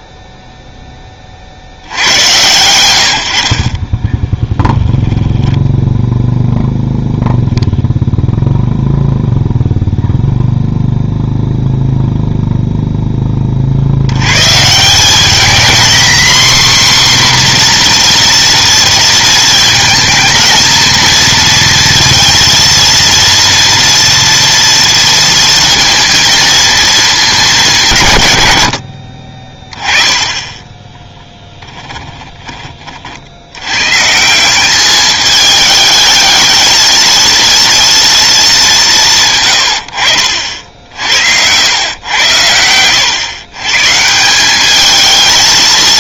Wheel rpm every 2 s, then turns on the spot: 10, 110, 10, 0, 0, 0, 0, 160, 260, 230, 230, 230, 230, 230, 90, 20, 30, 190, 220, 200, 60, 100, 200.
4-6 30-32